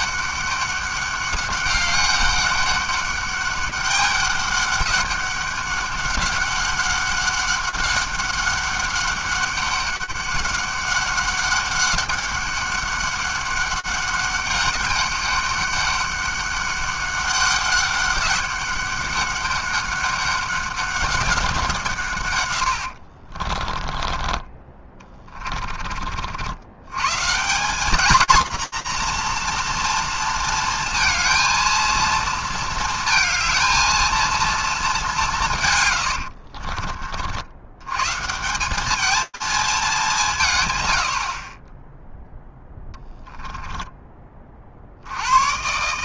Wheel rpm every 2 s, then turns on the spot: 200, 190, 200, 200, 200, 200, 200, 200, 200, 200, 200, 100, 20, 80, 240, 230, 230, 210, 40, 190, 110, 0, 40.
36-38